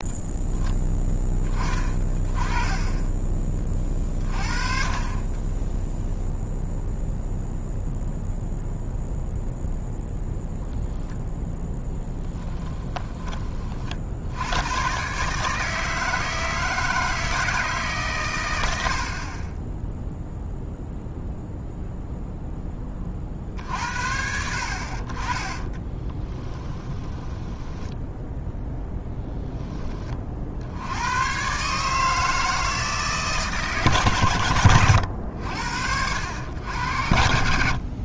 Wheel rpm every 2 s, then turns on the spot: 10, 20, 40, 0, 0, 0, 10, 120, 160, 80, 0, 20, 50, 10, 0, 80, 160, 90, 80.
26-28